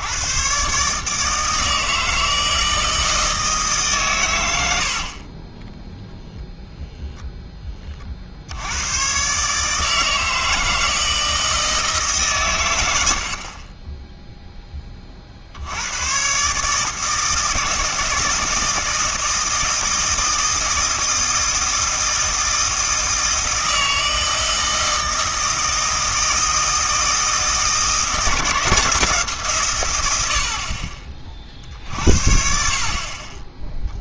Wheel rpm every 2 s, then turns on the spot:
140, 160, 80, 0, 100, 160, 100, 20, 150, 160, 160, 160, 160, 160, 170, 50, 50.
none